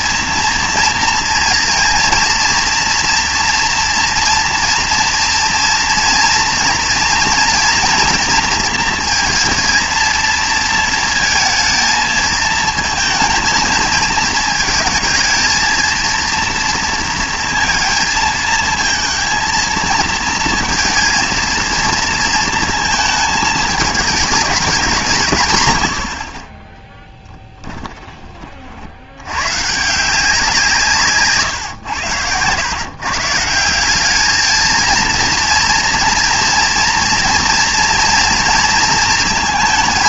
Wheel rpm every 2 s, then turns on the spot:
230, 230, 230, 230, 230, 230, 220, 220, 230, 230, 230, 230, 200, 20, 60, 160, 120, 220, 230, 230.
none